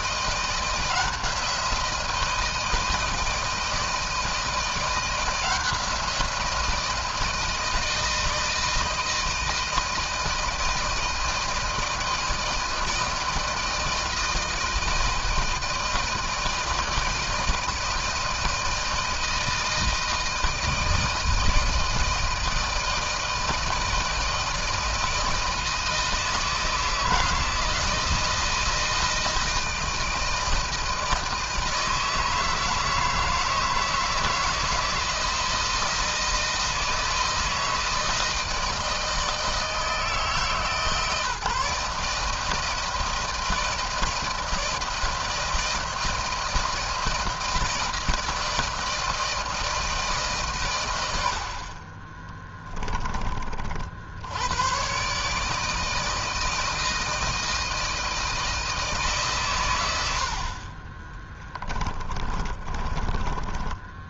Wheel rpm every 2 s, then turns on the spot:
170, 170, 170, 170, 160, 170, 160, 160, 160, 160, 160, 160, 160, 160, 170, 160, 160, 160, 160, 160, 160, 160, 160, 170, 160, 140, 20, 70, 160, 160, 60, 30.
52-54 62-64